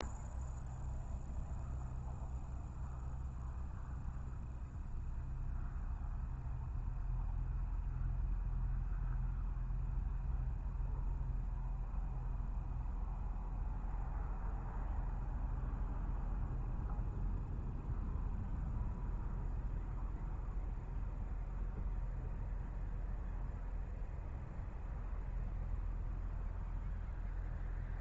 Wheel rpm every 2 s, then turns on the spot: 0, 0, 0, 0, 0, 0, 0, 0, 0, 0, 0, 0, 0, 0.
none